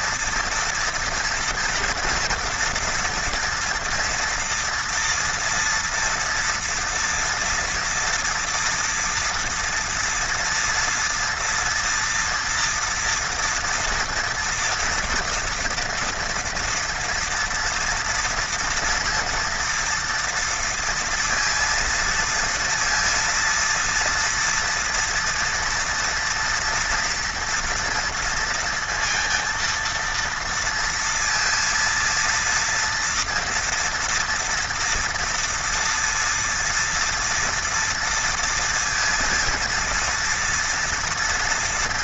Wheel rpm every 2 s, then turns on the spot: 230, 230, 240, 230, 230, 230, 230, 240, 230, 230, 230, 230, 230, 230, 230, 230, 230, 240, 230, 230, 230.
none